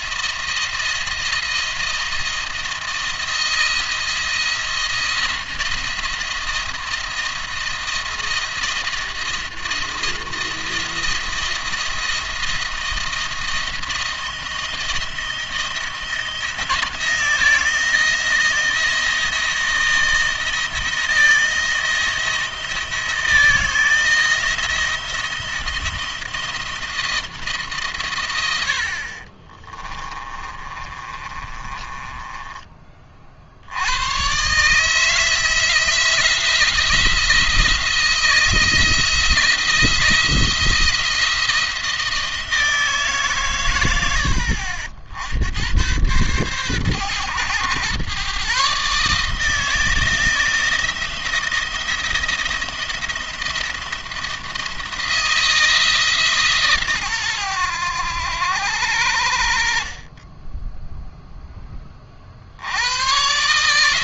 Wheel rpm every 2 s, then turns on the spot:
170, 170, 170, 170, 170, 170, 170, 170, 170, 170, 170, 160, 160, 170, 80, 30, 20, 140, 170, 170, 170, 160, 70, 120, 140, 160, 160, 170, 140, 90, 10, 80.
30-32